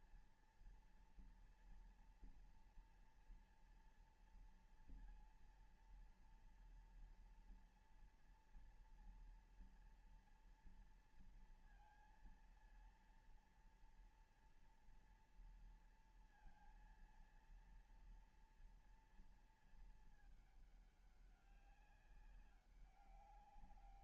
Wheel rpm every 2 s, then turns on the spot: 230, 240, 230, 230, 230, 230, 230, 230, 230, 230, 220, 200.
none